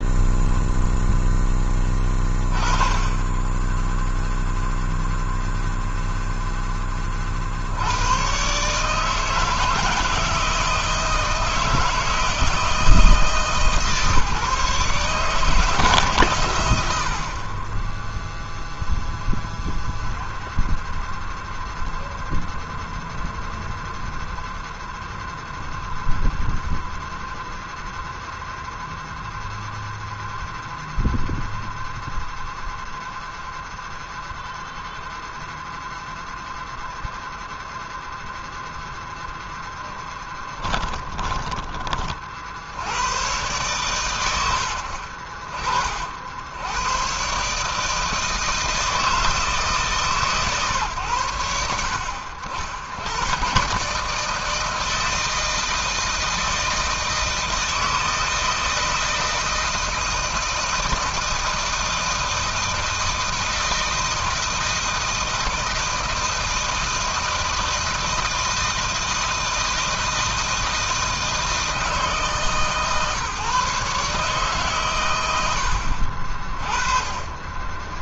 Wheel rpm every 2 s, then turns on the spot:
0, 20, 0, 40, 160, 160, 160, 160, 60, 0, 0, 0, 0, 0, 0, 0, 0, 0, 0, 0, 20, 120, 60, 130, 160, 100, 110, 160, 160, 160, 160, 160, 160, 160, 160, 160, 150, 110, 30.
40-42 76-78